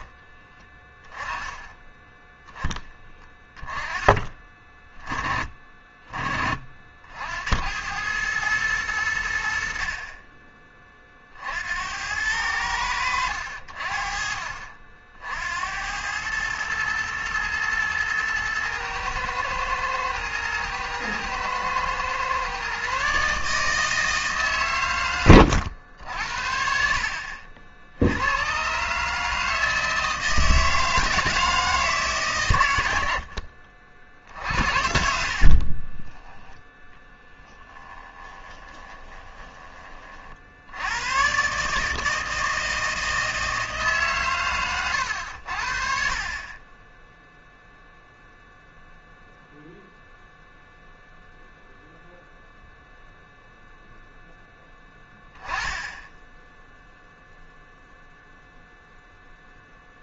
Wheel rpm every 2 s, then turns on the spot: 20, 10, 30, 40, 110, 30, 90, 50, 110, 110, 110, 130, 130, 60, 120, 160, 110, 60, 10, 20, 70, 160, 110, 30, 0, 0, 0, 10, 0, 0.
34-36 38-40